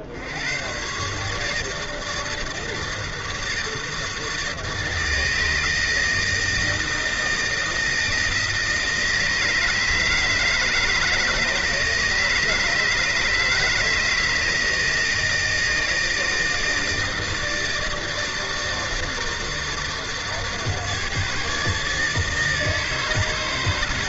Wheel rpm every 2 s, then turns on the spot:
100, 160, 160, 160, 160, 150, 160, 160, 160, 160, 150, 160.
none